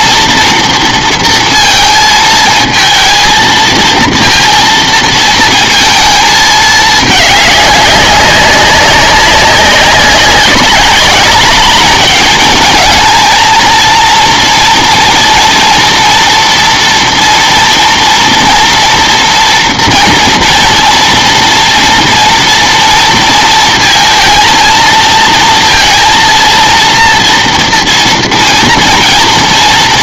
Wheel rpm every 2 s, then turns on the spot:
230, 220, 230, 210, 190, 190, 220, 240, 230, 230, 230, 230, 230, 230, 230.
none